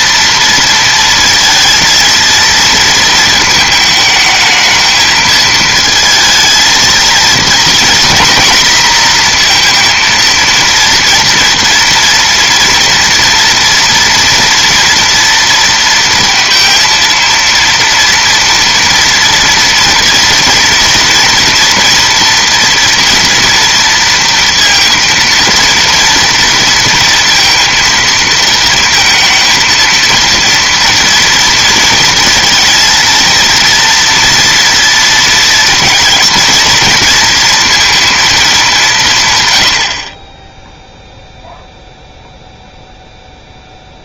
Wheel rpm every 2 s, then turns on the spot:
230, 230, 220, 230, 240, 230, 230, 230, 230, 230, 230, 230, 230, 230, 220, 230, 230, 230, 230, 200, 0, 0.
none